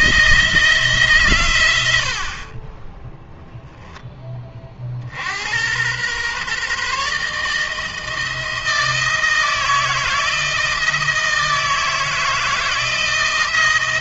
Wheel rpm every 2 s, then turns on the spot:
160, 20, 40, 140, 160, 160, 160.
none